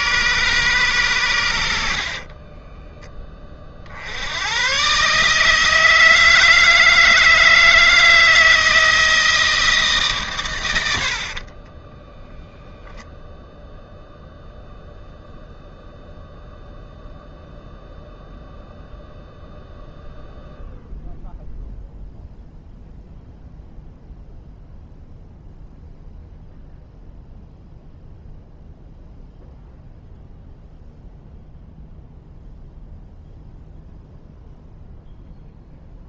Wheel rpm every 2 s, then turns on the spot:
130, 20, 110, 160, 160, 120, 0, 0, 0, 0, 0, 0, 0, 0, 0, 0, 0, 0.
2-4